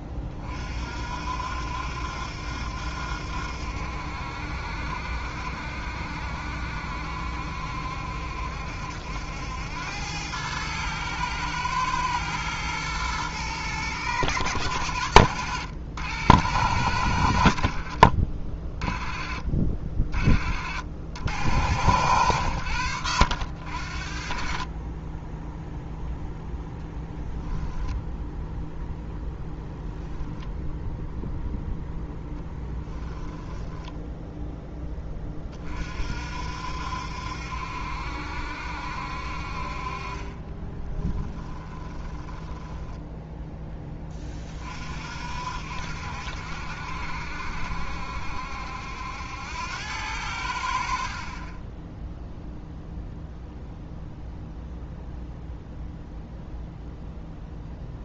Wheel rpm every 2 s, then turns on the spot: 30, 70, 70, 70, 70, 110, 110, 100, 100, 30, 60, 90, 30, 0, 0, 0, 10, 10, 60, 70, 20, 10, 40, 70, 70, 70, 0, 0, 0.
32-34 40-44